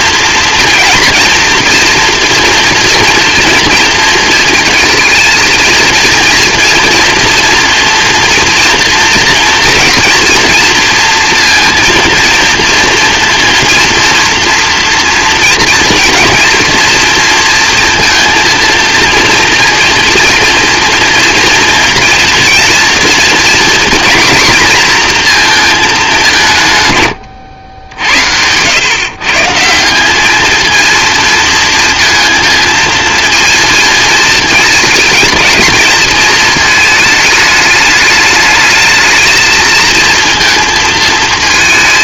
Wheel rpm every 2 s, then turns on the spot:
230, 230, 230, 230, 230, 230, 230, 230, 230, 230, 230, 230, 230, 140, 110, 220, 230, 220, 220, 210, 230.
none